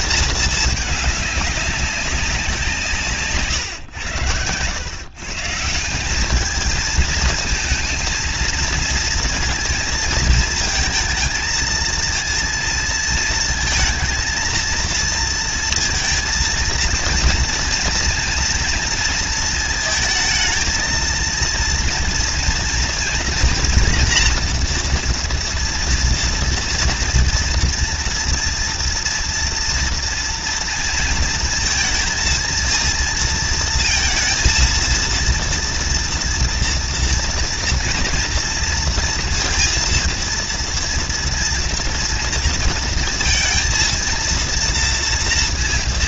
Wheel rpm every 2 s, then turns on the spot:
220, 180, 100, 210, 230, 220, 230, 230, 230, 230, 230, 230, 230, 230, 230, 230, 230, 230, 230, 230, 230, 230, 230.
none